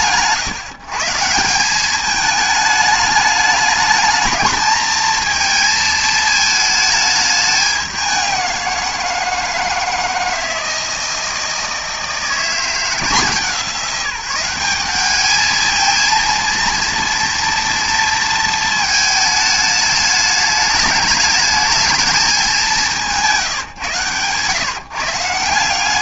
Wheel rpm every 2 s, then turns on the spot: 150, 210, 220, 210, 180, 170, 170, 190, 230, 220, 210, 190, 140.
none